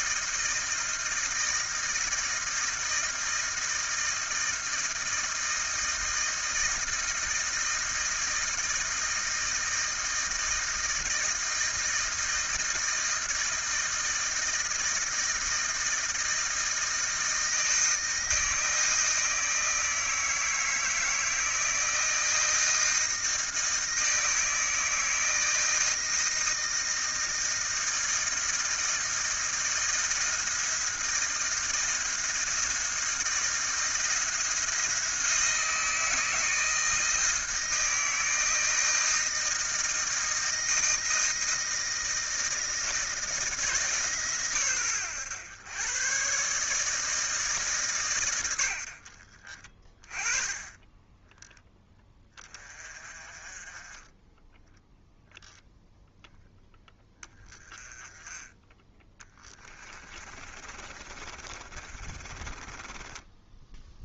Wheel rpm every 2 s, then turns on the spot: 160, 160, 160, 160, 160, 160, 160, 160, 160, 160, 160, 160, 160, 160, 160, 160, 170, 170, 160, 160, 160, 160, 120, 130, 110, 20, 20, 10, 0, 10, 30, 20.
60-64